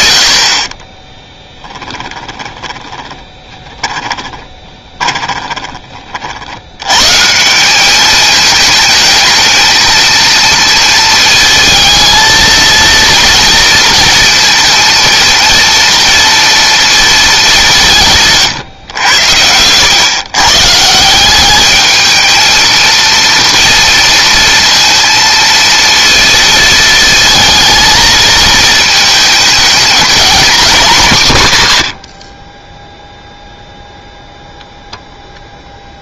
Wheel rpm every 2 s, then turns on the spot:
40, 10, 20, 90, 210, 230, 230, 230, 230, 120, 150, 230, 230, 220, 220, 220, 20, 0.
0-6